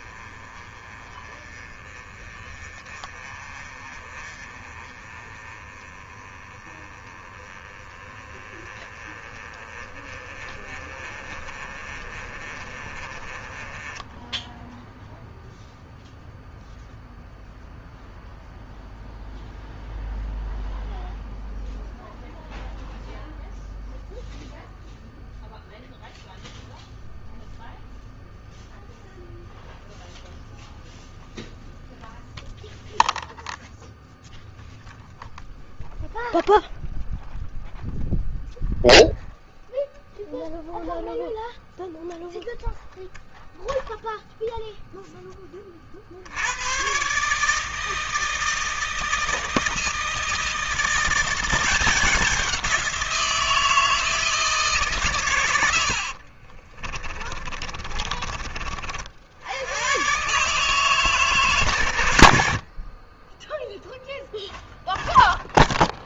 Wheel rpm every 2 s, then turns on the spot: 30, 30, 30, 20, 20, 30, 20, 0, 0, 0, 0, 0, 0, 0, 0, 0, 0, 0, 0, 0, 0, 0, 10, 130, 160, 170, 170, 130, 30, 50, 140, 30, 0.
56-58